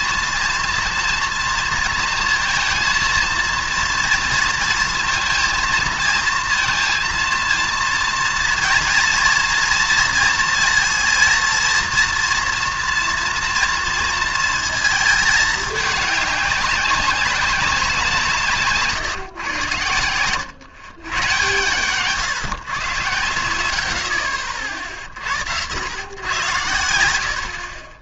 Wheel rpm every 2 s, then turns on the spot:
230, 230, 230, 230, 230, 230, 230, 220, 200, 140, 120, 110, 50, 90.
26-28